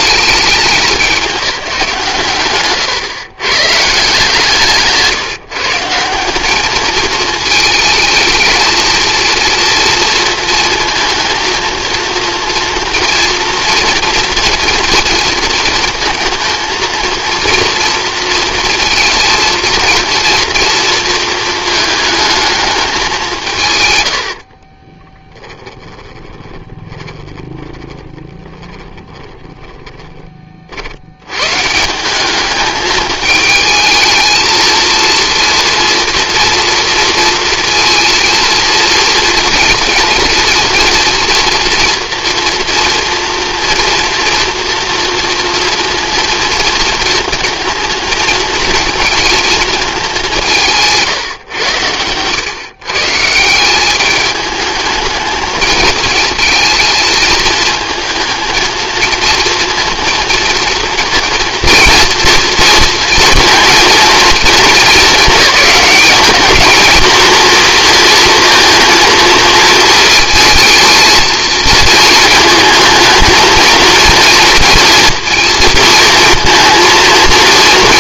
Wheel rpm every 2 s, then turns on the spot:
200, 120, 150, 220, 230, 230, 230, 230, 230, 230, 230, 210, 30, 20, 20, 70, 220, 230, 230, 220, 230, 230, 230, 230, 230, 170, 150, 210, 230, 230, 230, 230, 210, 220, 230, 220, 220, 230, 230.
24-30